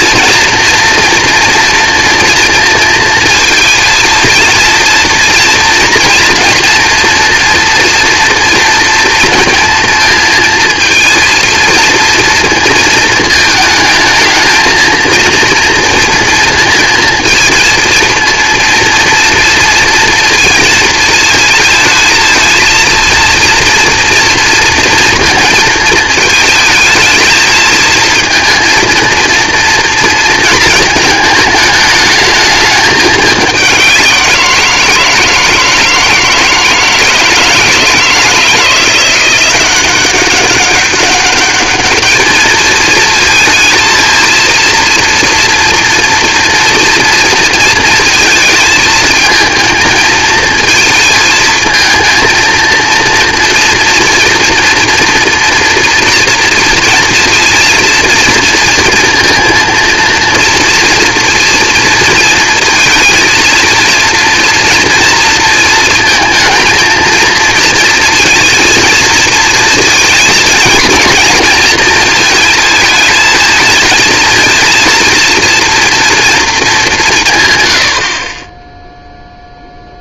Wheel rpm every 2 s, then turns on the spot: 230, 230, 230, 230, 230, 230, 230, 230, 230, 230, 230, 230, 230, 220, 230, 220, 210, 170, 160, 170, 190, 220, 230, 230, 220, 220, 230, 230, 230, 230, 230, 230, 230, 230, 230, 220, 220, 230, 200, 10.
none